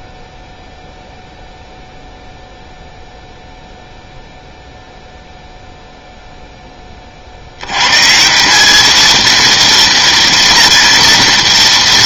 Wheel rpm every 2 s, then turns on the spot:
0, 0, 0, 10, 190, 240.
none